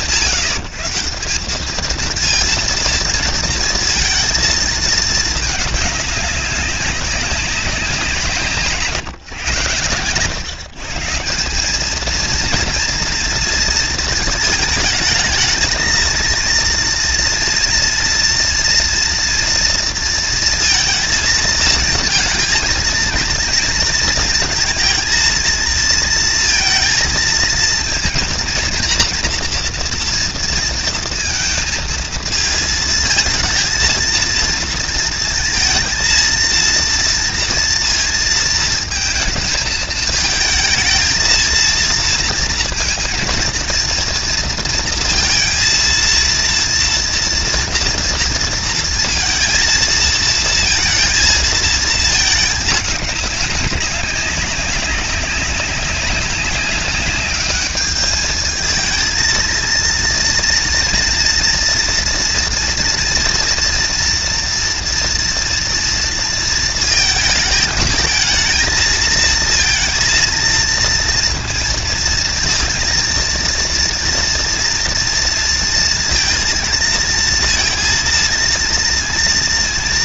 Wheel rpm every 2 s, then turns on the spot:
150, 230, 220, 190, 140, 140, 230, 220, 230, 230, 230, 230, 230, 230, 240, 230, 220, 230, 230, 220, 220, 230, 230, 230, 230, 230, 210, 190, 190, 220, 230, 230, 230, 230, 220, 230, 230, 230, 230, 230.
none